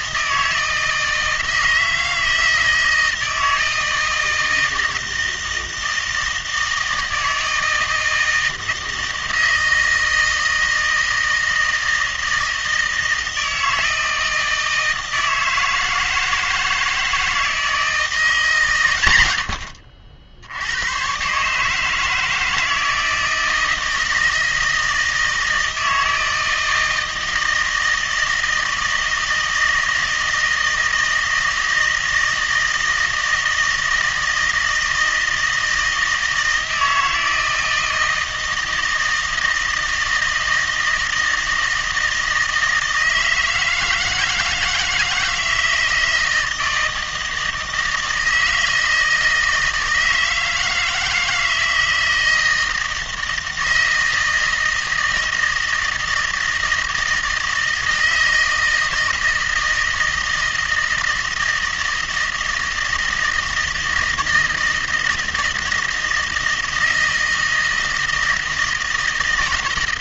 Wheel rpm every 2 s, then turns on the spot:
160, 160, 160, 160, 160, 160, 160, 160, 160, 140, 90, 160, 160, 160, 160, 160, 160, 160, 160, 160, 160, 160, 160, 160, 160, 160, 160, 160, 160, 160, 160, 160, 160, 160, 160.
none